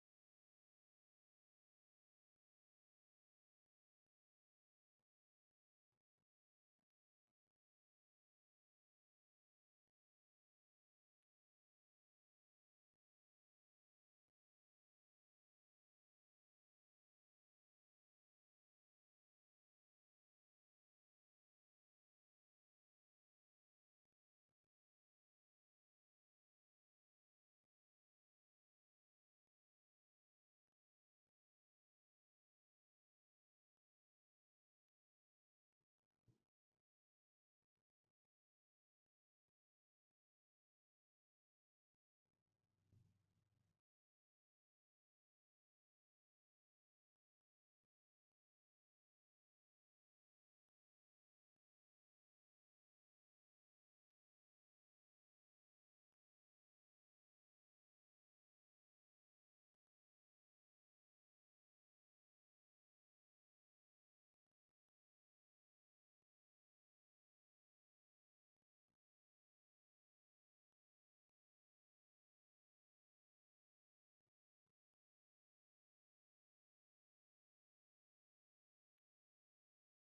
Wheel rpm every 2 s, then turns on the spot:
0, 0, 0, 0, 0, 0, 0, 0, 0, 0, 0, 0, 0, 0, 0, 0, 0, 0, 0, 0, 0, 0, 0, 0, 0, 0, 0, 0, 0, 0, 0, 0, 0, 0, 0, 0, 0, 0, 0, 0.
none